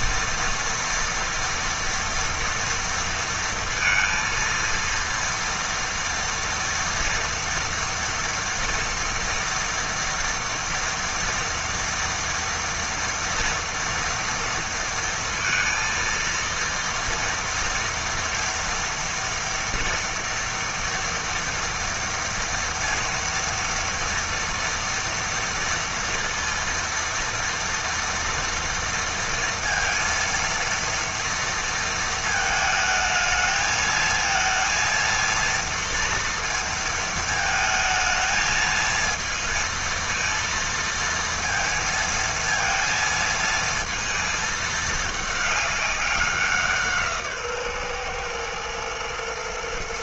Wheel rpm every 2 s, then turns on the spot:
230, 230, 230, 230, 230, 230, 230, 230, 230, 230, 230, 230, 230, 230, 230, 230, 220, 230, 230, 220, 230, 230, 220, 180, 120.
none